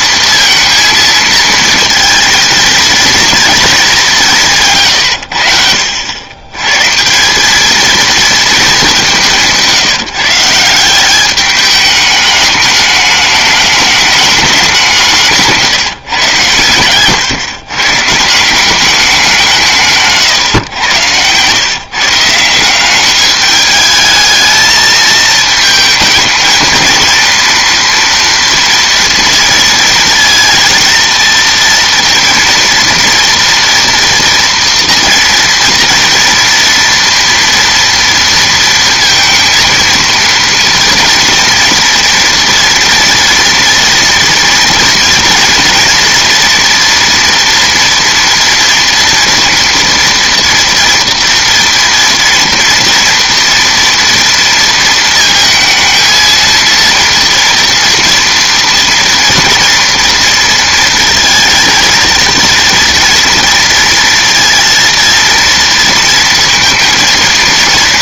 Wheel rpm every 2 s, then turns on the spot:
230, 230, 150, 120, 220, 160, 210, 200, 110, 180, 120, 180, 220, 220, 230, 230, 230, 230, 230, 230, 230, 230, 230, 240, 230, 230, 230, 230, 230, 230, 230, 230, 230, 230.
none